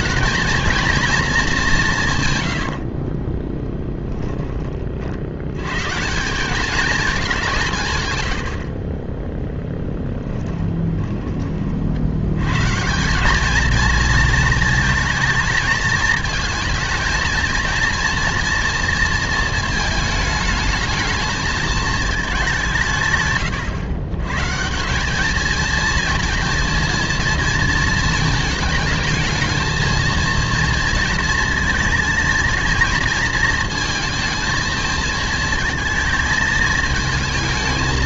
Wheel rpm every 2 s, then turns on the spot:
230, 100, 20, 210, 50, 20, 130, 220, 220, 230, 210, 180, 150, 230, 220, 230, 230, 220, 220.
2-4 10-12